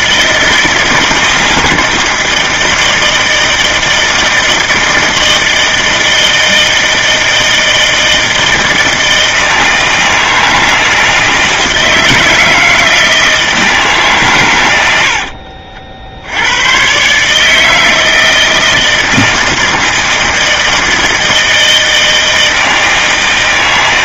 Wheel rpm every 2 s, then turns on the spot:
160, 160, 160, 160, 160, 160, 170, 120, 100, 160, 160, 160.
none